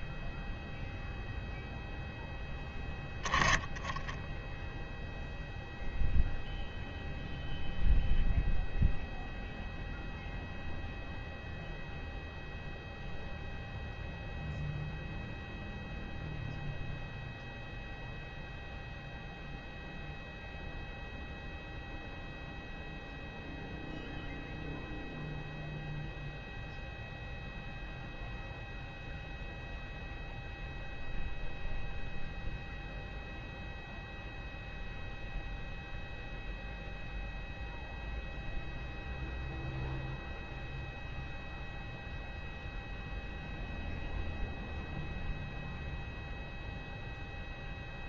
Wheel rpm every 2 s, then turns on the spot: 0, 10, 0, 0, 0, 0, 0, 0, 0, 0, 0, 0, 0, 0, 0, 0, 0, 0, 0, 0, 0, 0, 0, 0.
none